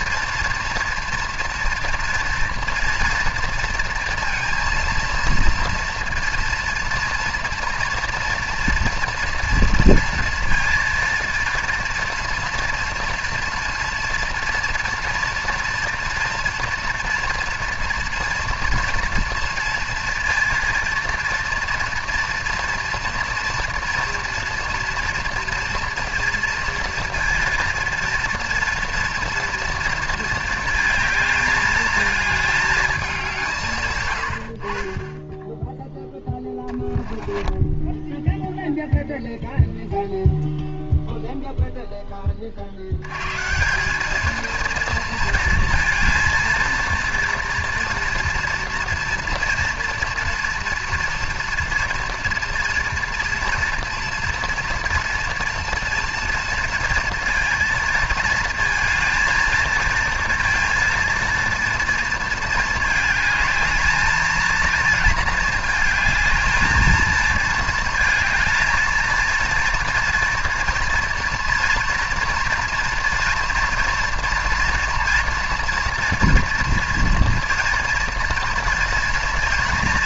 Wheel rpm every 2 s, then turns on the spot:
240, 230, 230, 240, 230, 230, 230, 240, 240, 230, 230, 230, 240, 230, 230, 220, 200, 30, 10, 0, 0, 90, 230, 230, 230, 230, 230, 230, 230, 230, 230, 220, 230, 220, 230, 230, 230, 230, 230, 230.
36-38